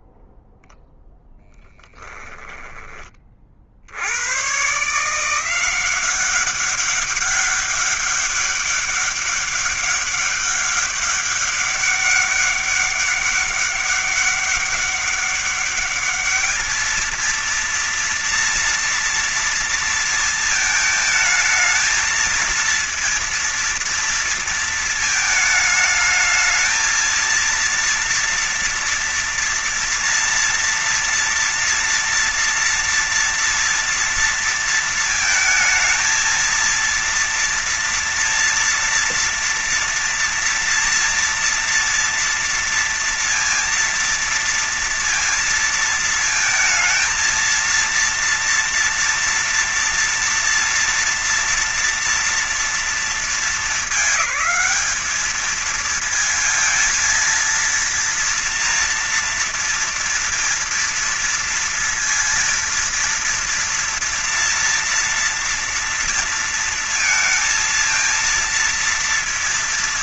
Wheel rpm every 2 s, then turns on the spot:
0, 10, 110, 190, 200, 200, 200, 200, 210, 230, 230, 220, 230, 220, 230, 230, 230, 230, 230, 240, 230, 230, 230, 220, 230, 230, 230, 210, 220, 230, 230, 230, 230, 230, 230.
none